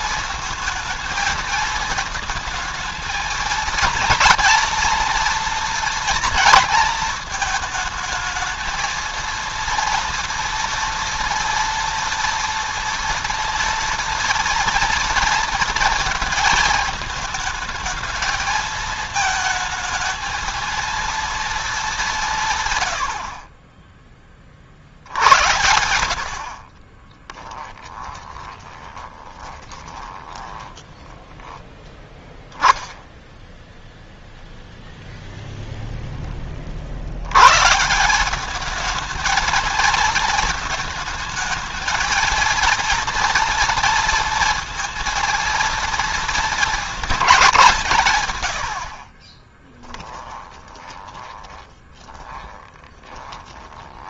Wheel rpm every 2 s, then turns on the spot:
220, 220, 230, 230, 220, 230, 230, 230, 220, 220, 230, 140, 40, 50, 20, 20, 10, 0, 30, 200, 220, 230, 230, 230, 110, 20, 20.
26-32 50-54